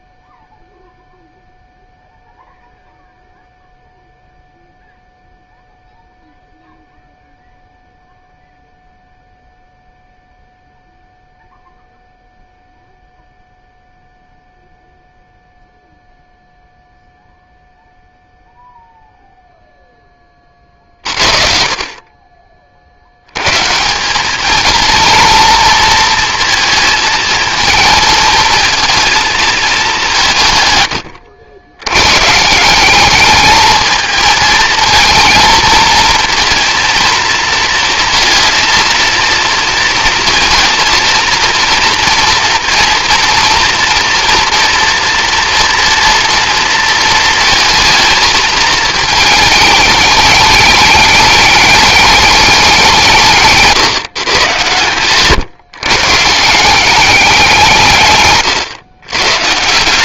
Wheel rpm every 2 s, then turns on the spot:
0, 0, 0, 0, 0, 0, 0, 0, 0, 0, 60, 100, 230, 220, 220, 80, 210, 230, 230, 230, 230, 230, 230, 220, 220, 210, 160, 130, 190, 110.
none